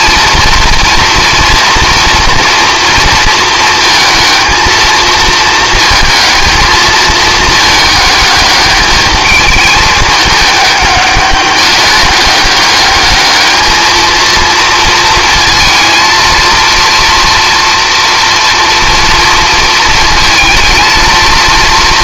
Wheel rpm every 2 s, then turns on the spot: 230, 230, 230, 230, 210, 200, 210, 230, 230, 230, 230.
none